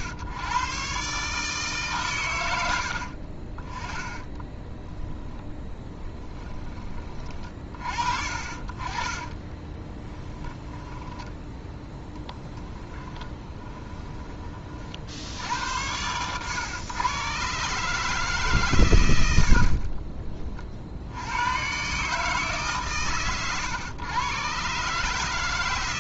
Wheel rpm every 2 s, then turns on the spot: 120, 90, 30, 20, 40, 10, 20, 40, 120, 140, 50, 140, 130.
4-8 10-14